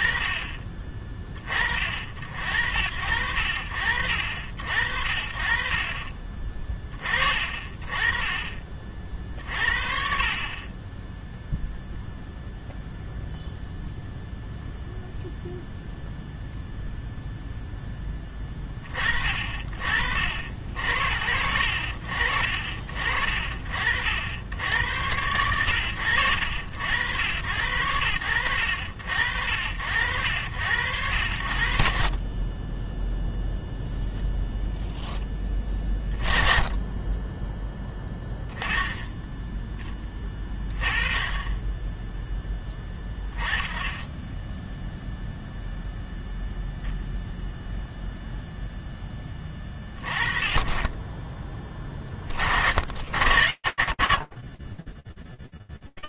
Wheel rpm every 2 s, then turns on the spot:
40, 60, 40, 30, 60, 0, 0, 0, 0, 40, 60, 50, 90, 80, 50, 80, 0, 20, 10, 0, 10, 20, 0, 0, 20, 10, 90, 20.
42-44